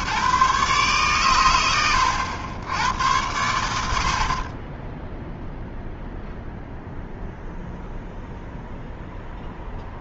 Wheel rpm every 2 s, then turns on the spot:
140, 70, 60, 0, 0.
none